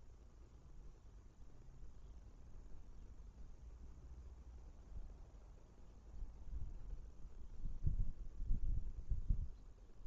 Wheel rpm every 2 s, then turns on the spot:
0, 0, 0, 0, 0.
none